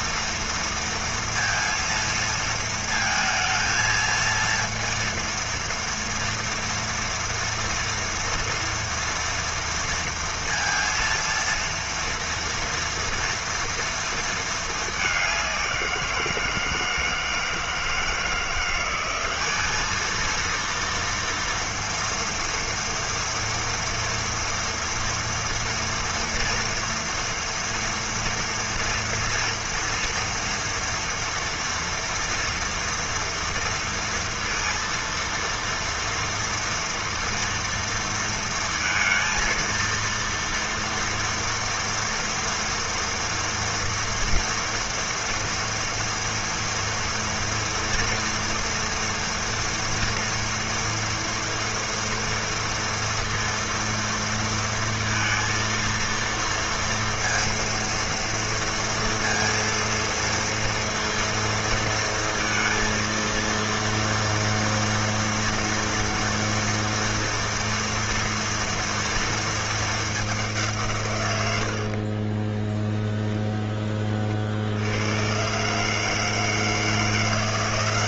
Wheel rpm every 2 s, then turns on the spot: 230, 230, 230, 240, 230, 230, 230, 230, 170, 170, 230, 230, 240, 230, 230, 230, 230, 230, 230, 230, 230, 230, 230, 230, 230, 230, 230, 230, 230, 230, 230, 230, 230, 230, 230, 200, 30, 50, 160.
72-74